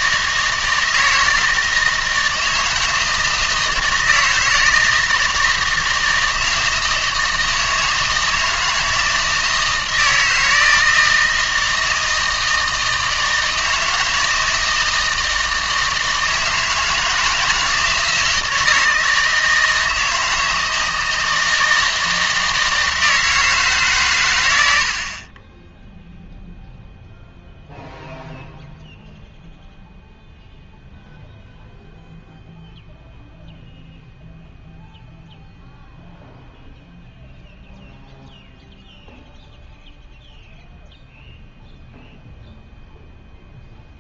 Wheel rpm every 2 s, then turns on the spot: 160, 160, 160, 160, 160, 160, 160, 160, 160, 160, 160, 160, 90, 0, 0, 0, 0, 0, 0, 0, 0, 0.
none